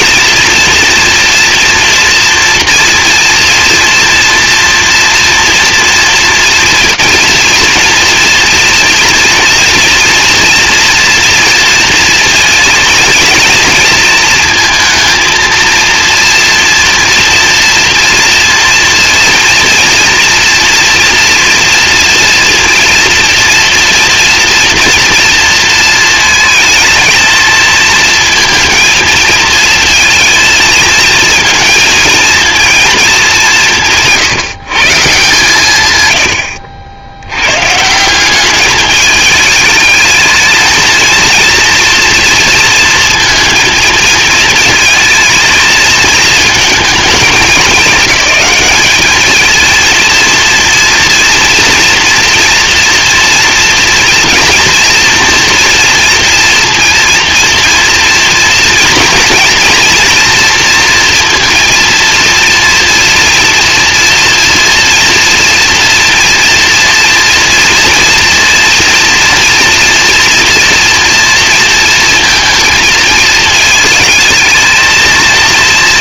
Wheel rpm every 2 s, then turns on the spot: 240, 230, 230, 230, 230, 230, 230, 230, 240, 230, 230, 230, 230, 220, 220, 230, 230, 150, 80, 210, 230, 230, 220, 220, 210, 230, 240, 230, 230, 230, 230, 230, 230, 230, 230, 230, 230, 230.
none